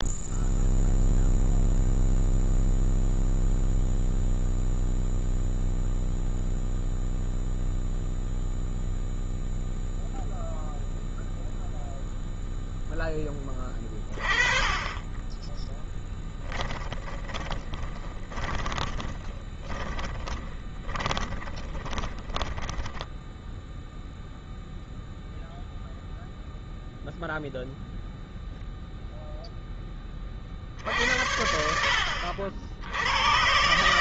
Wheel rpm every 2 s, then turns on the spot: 0, 0, 0, 0, 0, 0, 0, 30, 10, 20, 10, 20, 0, 0, 0, 30, 70.
16-24